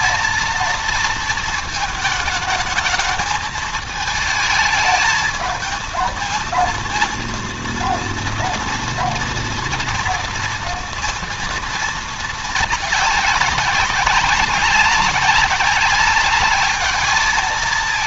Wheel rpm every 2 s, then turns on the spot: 220, 220, 220, 220, 230, 230, 220, 190, 210.
none